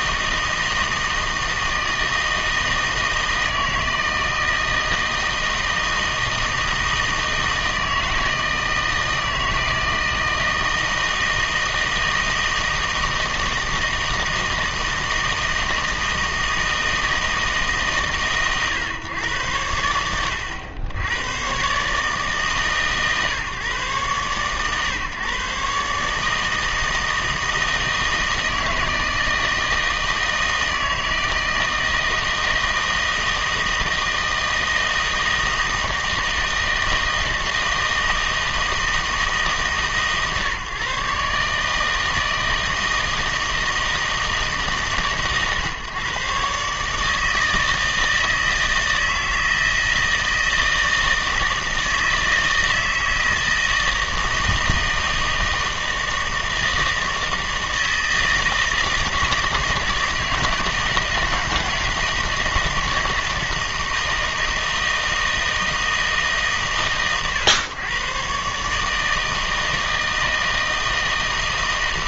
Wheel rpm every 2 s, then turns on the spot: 160, 160, 160, 160, 160, 160, 160, 160, 160, 130, 80, 150, 130, 160, 160, 160, 160, 160, 160, 160, 140, 160, 150, 140, 160, 160, 160, 160, 160, 160, 160, 160, 160, 130, 140, 160.
none